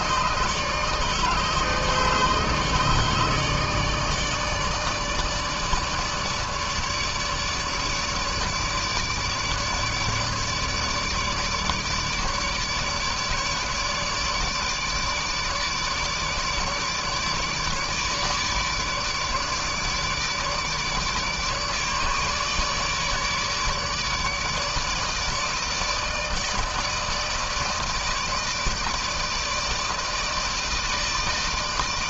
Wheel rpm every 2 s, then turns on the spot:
150, 150, 150, 150, 150, 150, 150, 150, 150, 150, 150, 150, 150, 160, 150, 160.
none